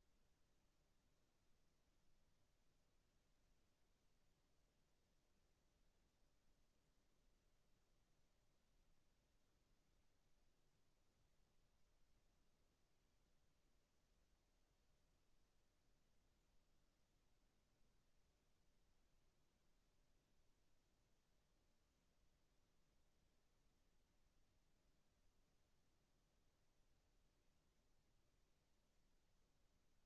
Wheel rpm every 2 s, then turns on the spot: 0, 0, 0, 0, 0, 0, 0, 0, 0, 0, 0, 0, 0, 0, 0.
none